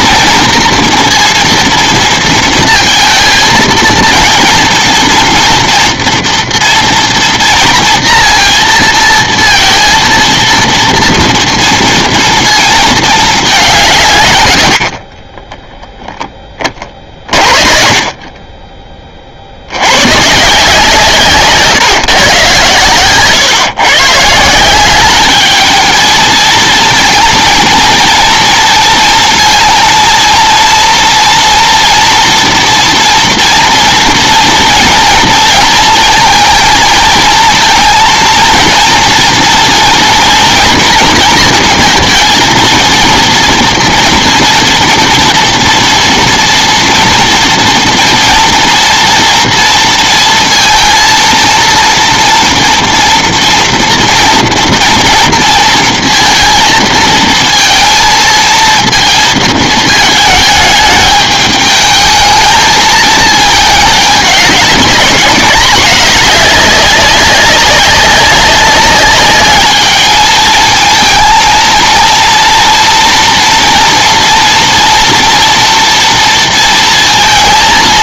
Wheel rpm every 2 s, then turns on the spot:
230, 230, 230, 230, 230, 230, 230, 100, 30, 30, 150, 140, 170, 230, 230, 230, 240, 230, 230, 230, 230, 230, 240, 230, 230, 230, 230, 230, 230, 230, 220, 220, 200, 200, 190, 220, 230, 230, 230.
none